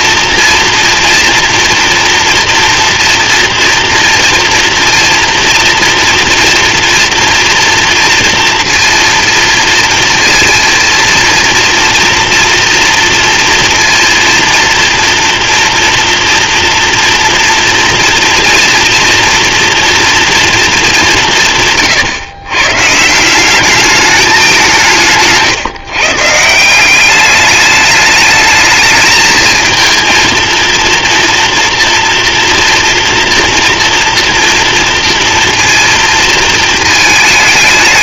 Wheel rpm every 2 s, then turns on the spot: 230, 230, 240, 230, 230, 230, 240, 230, 230, 230, 180, 160, 160, 200, 220, 230, 230, 230, 220.
none